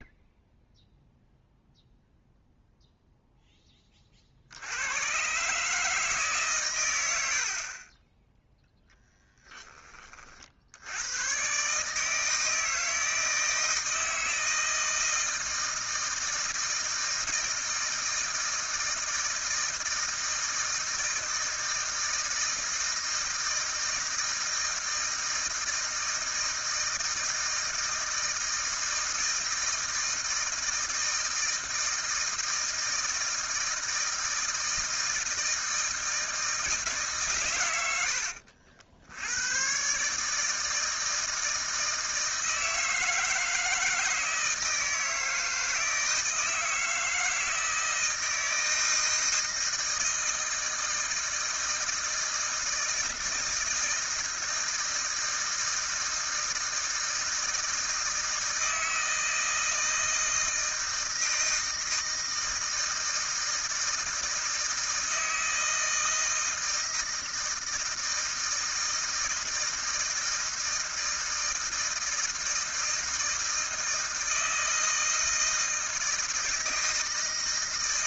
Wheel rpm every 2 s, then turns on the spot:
0, 0, 70, 130, 0, 70, 160, 160, 160, 160, 160, 160, 160, 160, 160, 160, 160, 160, 160, 60, 160, 160, 160, 160, 160, 160, 160, 160, 160, 160, 160, 160, 160, 160, 160, 160, 160, 160, 160.
none